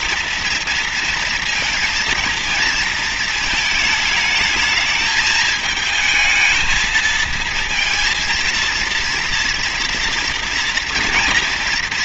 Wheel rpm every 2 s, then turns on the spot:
230, 230, 220, 220, 230, 240.
none